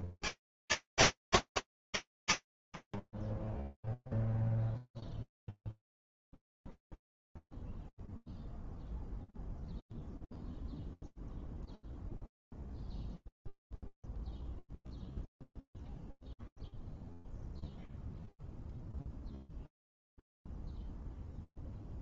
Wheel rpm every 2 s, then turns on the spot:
60, 20, 0, 0, 0, 0, 0, 0, 0, 0, 0.
none